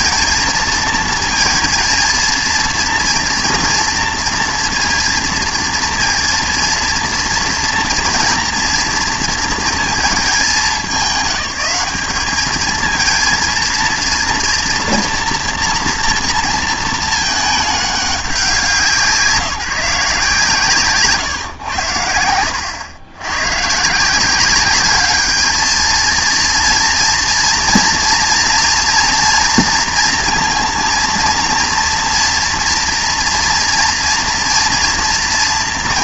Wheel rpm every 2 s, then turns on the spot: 230, 230, 240, 230, 230, 210, 210, 230, 230, 180, 150, 100, 190, 230, 230, 230, 240, 230.
none